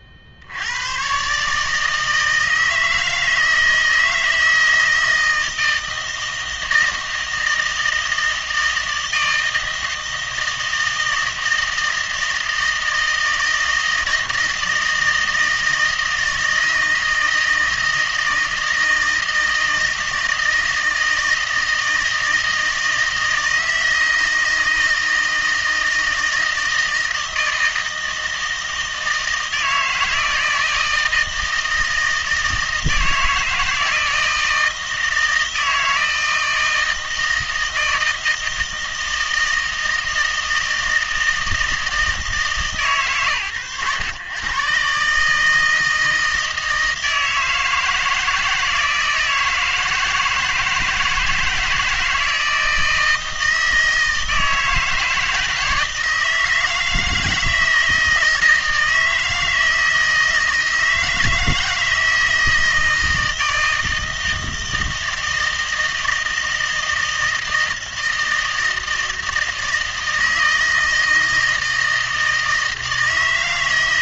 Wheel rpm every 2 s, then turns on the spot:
80, 160, 160, 160, 160, 160, 160, 160, 160, 160, 160, 160, 160, 160, 160, 160, 160, 160, 160, 160, 160, 140, 120, 160, 160, 160, 160, 160, 160, 160, 160, 160, 160, 160, 160, 160, 160.
none